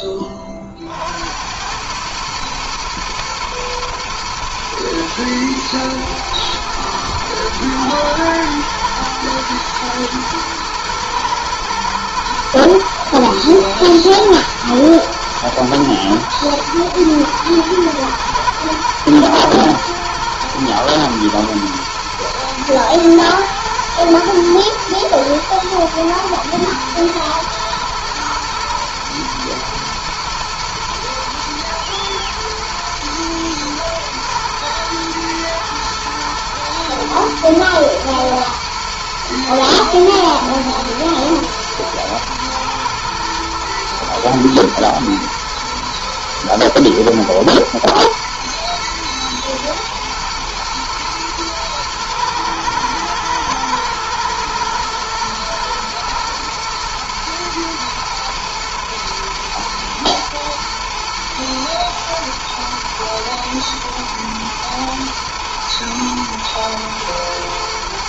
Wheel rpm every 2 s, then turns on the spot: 50, 110, 110, 110, 110, 110, 110, 120, 110, 110, 110, 110, 110, 110, 110, 110, 120, 110, 110, 120, 110, 110, 110, 110, 110, 110, 110, 110, 120, 120, 110, 110, 110, 110.
none